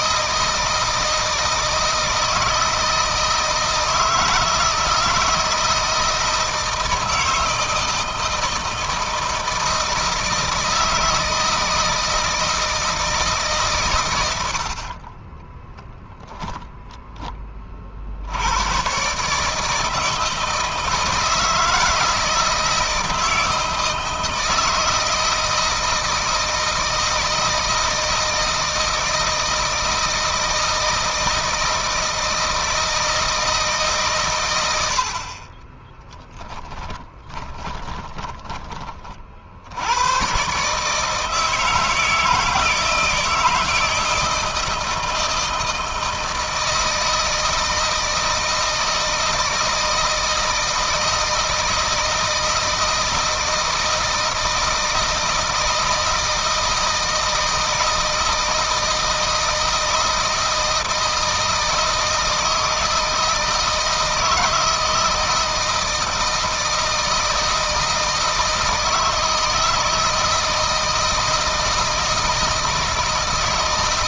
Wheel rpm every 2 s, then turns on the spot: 170, 160, 160, 160, 160, 160, 160, 50, 10, 120, 160, 160, 160, 160, 160, 160, 160, 90, 30, 30, 140, 160, 160, 160, 160, 160, 160, 160, 160, 160, 160, 160, 160, 160, 160, 160, 160.
36-38